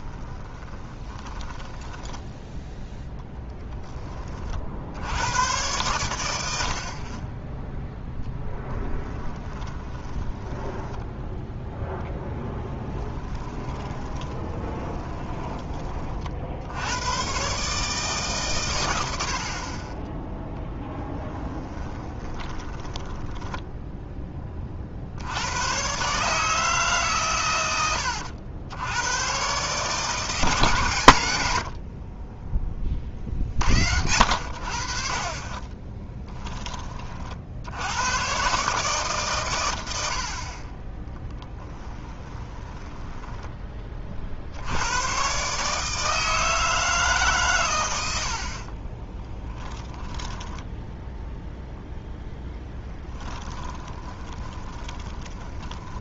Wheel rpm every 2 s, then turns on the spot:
20, 0, 70, 50, 10, 10, 20, 20, 80, 100, 0, 20, 40, 150, 90, 120, 20, 60, 30, 150, 30, 20, 100, 160, 30, 10, 10, 20.
0-2 8-16 22-24 42-44 48-56